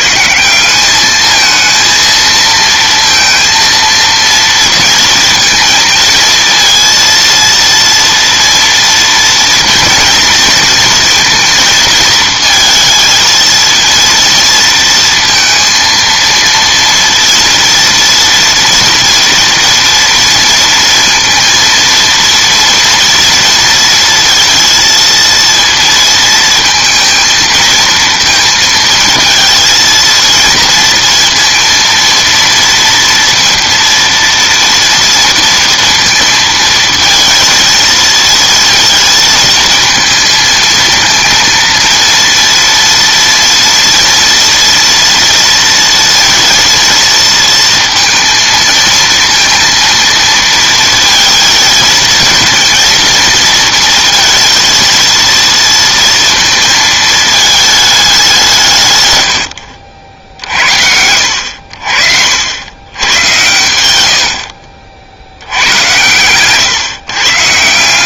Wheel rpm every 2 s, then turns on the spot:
210, 230, 230, 230, 230, 230, 220, 230, 230, 230, 230, 230, 230, 220, 230, 230, 230, 230, 230, 230, 230, 230, 230, 230, 220, 220, 230, 230, 220, 110, 70, 100, 70, 140.
none